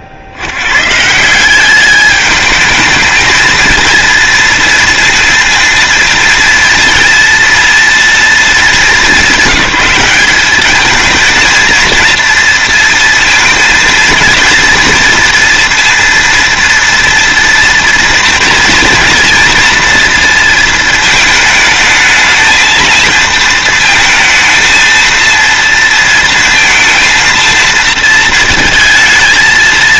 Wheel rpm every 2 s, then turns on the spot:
70, 210, 230, 230, 220, 210, 230, 230, 230, 240, 230, 220, 230, 230, 220.
none